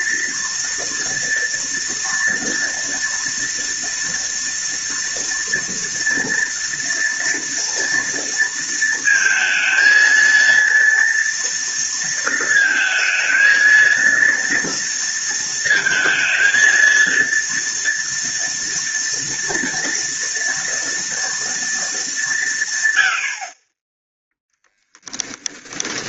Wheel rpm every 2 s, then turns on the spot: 230, 230, 230, 230, 230, 230, 220, 230, 230, 230, 230, 100, 0.
none